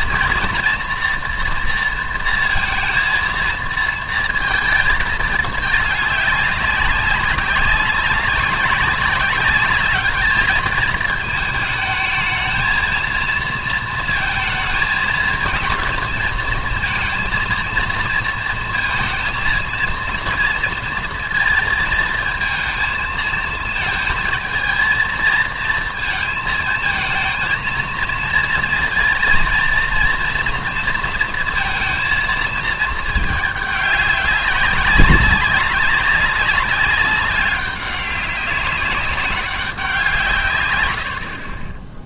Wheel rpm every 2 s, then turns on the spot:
230, 230, 230, 200, 200, 220, 220, 220, 220, 230, 240, 220, 220, 220, 230, 240, 220, 190, 190, 190, 120.
none